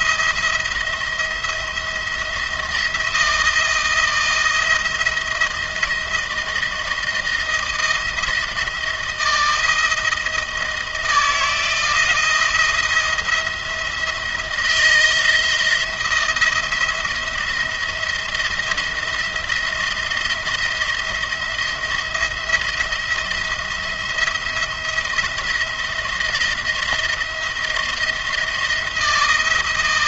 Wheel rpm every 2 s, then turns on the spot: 160, 170, 170, 170, 160, 160, 160, 170, 170, 170, 170, 170, 170, 170, 170.
none